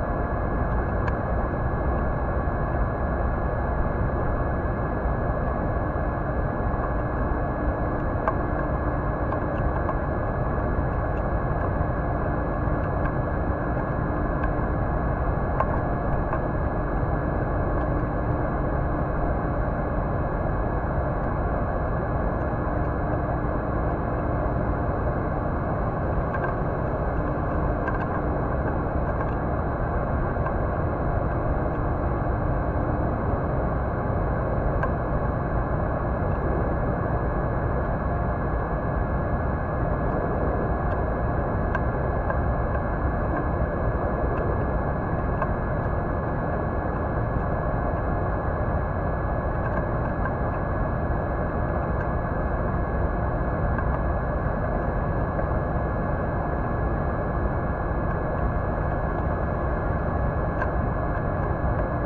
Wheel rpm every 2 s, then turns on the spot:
0, 0, 0, 0, 0, 0, 0, 0, 0, 0, 0, 0, 0, 0, 0, 0, 0, 0, 0, 0, 0, 0, 0, 0, 0, 0, 0, 0, 0, 0, 0.
none